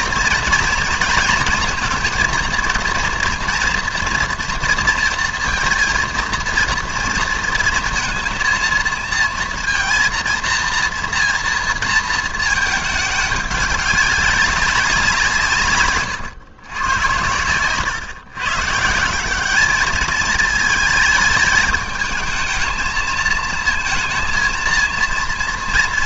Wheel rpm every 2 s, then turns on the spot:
230, 230, 230, 230, 230, 230, 220, 200, 120, 140, 220, 220, 230.
none